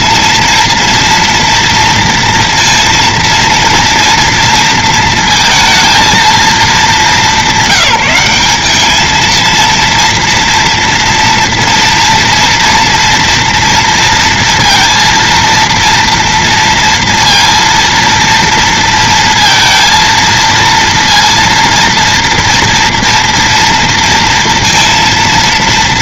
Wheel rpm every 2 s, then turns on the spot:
230, 230, 230, 210, 210, 240, 230, 230, 230, 230, 230, 230, 230.
none